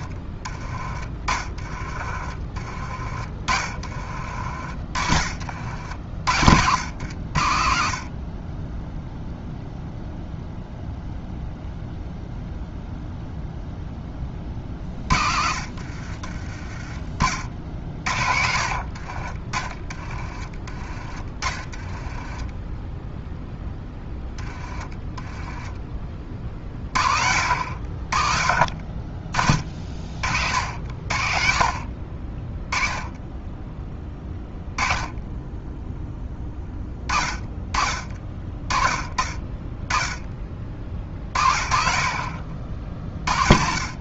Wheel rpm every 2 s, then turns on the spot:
20, 30, 50, 80, 10, 0, 0, 40, 30, 50, 20, 10, 20, 60, 40, 60, 10, 20, 20, 40, 30, 30.
0-4 14-16 18-22